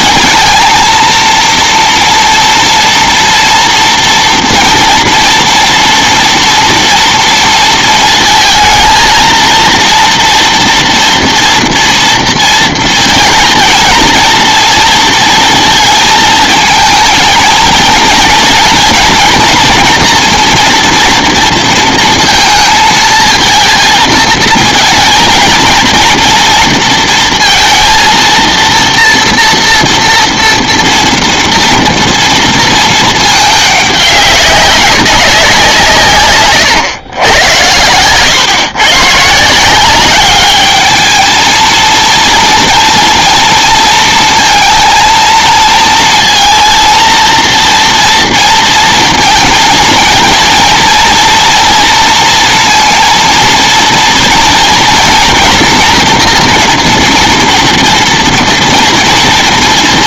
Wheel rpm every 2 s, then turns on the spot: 230, 230, 240, 230, 230, 230, 230, 230, 220, 230, 240, 230, 230, 230, 230, 230, 230, 200, 120, 120, 210, 230, 230, 230, 230, 230, 230, 240, 240, 230.
none